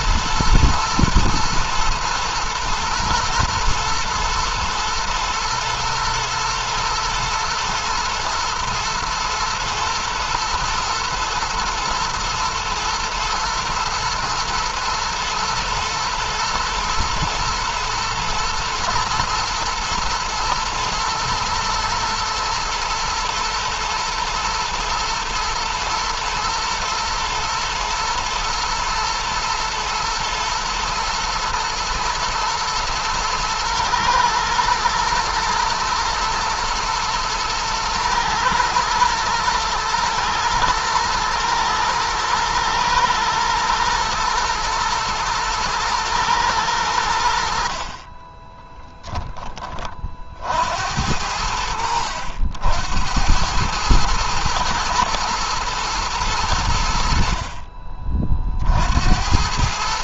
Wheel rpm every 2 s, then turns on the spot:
120, 120, 110, 120, 110, 110, 110, 120, 120, 110, 110, 110, 110, 120, 110, 120, 110, 110, 120, 110, 110, 110, 120, 100, 10, 70, 100, 110, 90, 60.
48-50